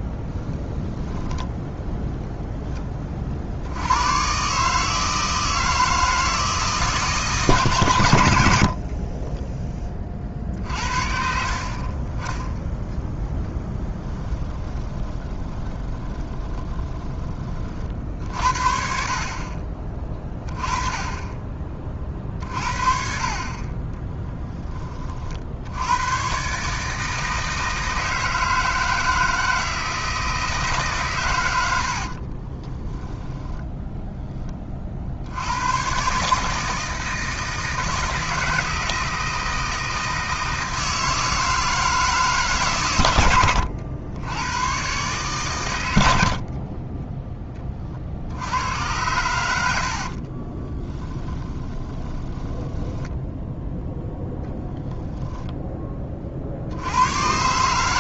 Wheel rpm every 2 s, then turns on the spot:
0, 20, 150, 160, 60, 40, 10, 20, 20, 50, 20, 50, 20, 150, 160, 140, 20, 50, 160, 160, 160, 130, 120, 30, 100, 30, 10, 0, 80.
8-10 14-18 32-34 50-54